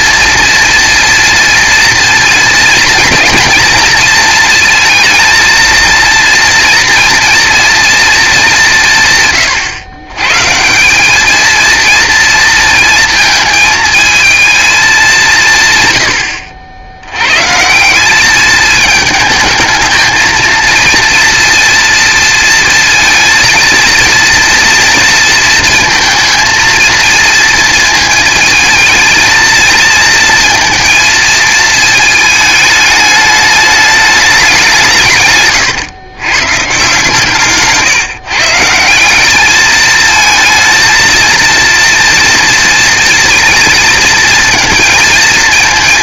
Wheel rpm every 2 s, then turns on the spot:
230, 230, 230, 230, 160, 190, 230, 210, 90, 220, 230, 230, 230, 230, 220, 230, 210, 170, 150, 180, 230, 230, 220.
none